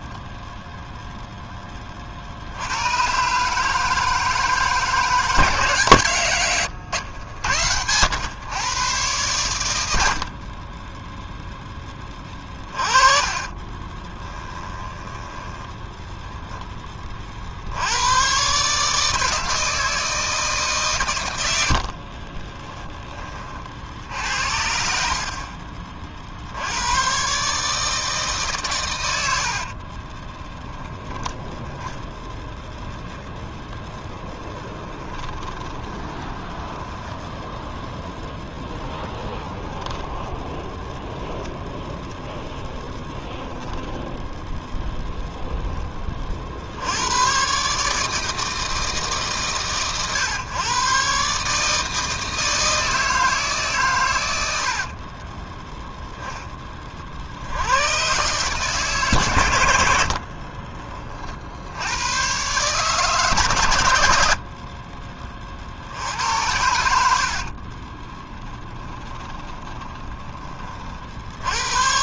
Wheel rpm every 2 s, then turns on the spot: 0, 100, 150, 100, 120, 10, 30, 10, 20, 150, 140, 30, 70, 90, 130, 10, 0, 20, 20, 10, 10, 10, 0, 60, 150, 130, 160, 60, 20, 140, 40, 130, 40, 80, 20, 40.
6-8 10-18 22-26 34-38 40-42 54-56 60-62 64-66 68-70